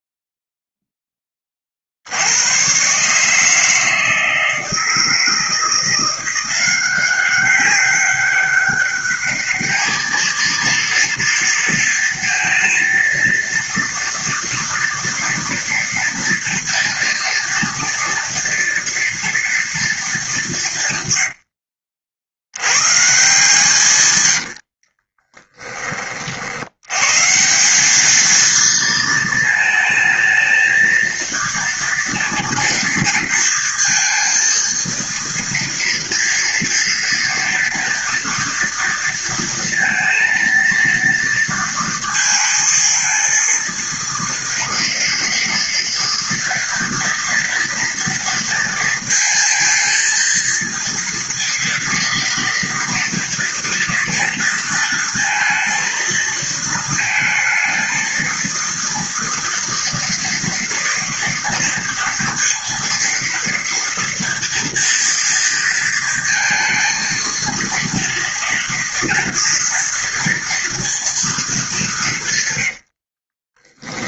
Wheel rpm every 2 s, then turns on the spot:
0, 100, 160, 180, 200, 220, 230, 230, 230, 240, 180, 80, 80, 70, 220, 220, 230, 230, 230, 230, 230, 230, 230, 230, 230, 230, 230, 230, 230, 230, 230, 230, 230, 230, 230, 230, 130.
24-26